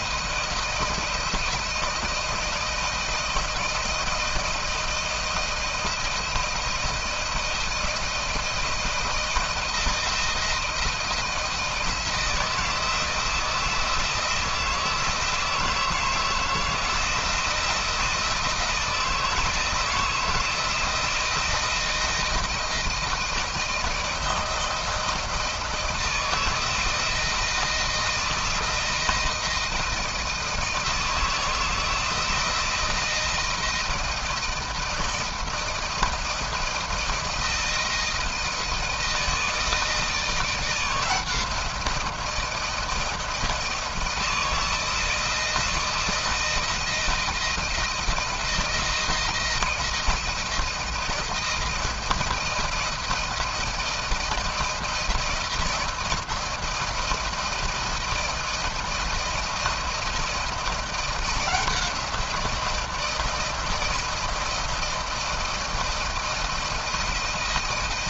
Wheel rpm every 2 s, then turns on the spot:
160, 170, 170, 170, 160, 160, 160, 160, 170, 160, 160, 170, 160, 160, 160, 160, 170, 170, 160, 160, 170, 160, 160, 160, 170, 170, 170, 170, 160, 160, 170, 170, 160, 160.
none